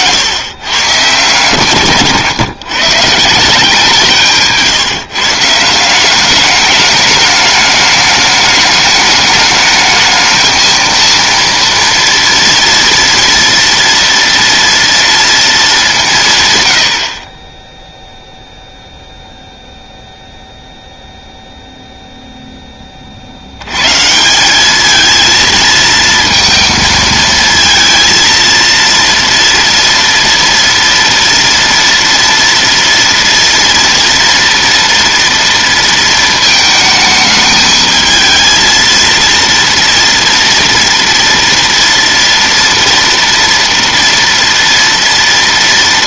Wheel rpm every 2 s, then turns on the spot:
120, 140, 150, 210, 210, 230, 230, 230, 100, 0, 0, 20, 210, 230, 230, 230, 230, 230, 220, 230, 230, 240, 230.
none